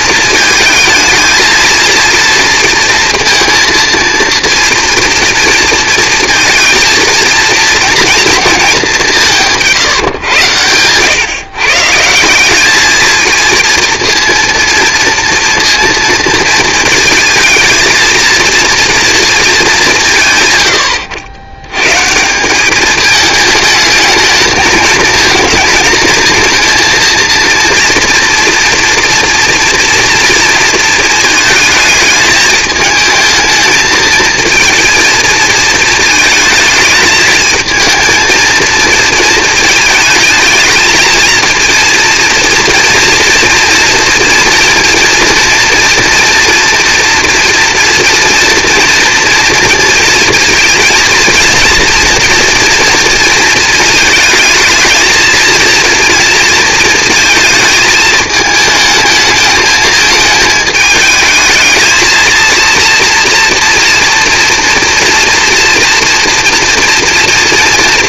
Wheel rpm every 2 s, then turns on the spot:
220, 230, 230, 230, 220, 110, 200, 230, 230, 230, 120, 190, 220, 220, 240, 230, 210, 230, 220, 230, 220, 230, 230, 230, 230, 230, 230, 220, 230, 220, 220, 230, 230, 230.
10-12